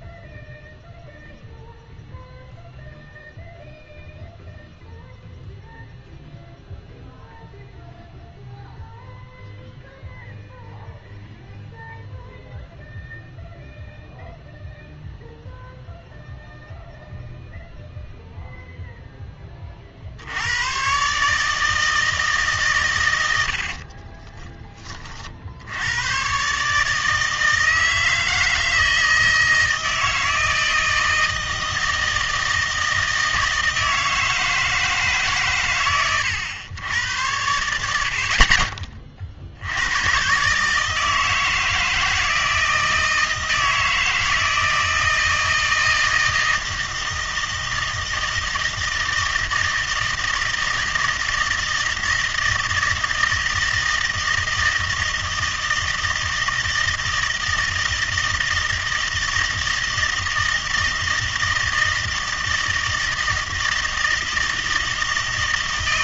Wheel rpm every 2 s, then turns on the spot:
0, 0, 0, 0, 0, 0, 0, 0, 0, 0, 100, 140, 20, 140, 160, 160, 160, 160, 100, 40, 150, 160, 160, 160, 160, 160, 160, 160, 160, 160, 160, 160, 160.
none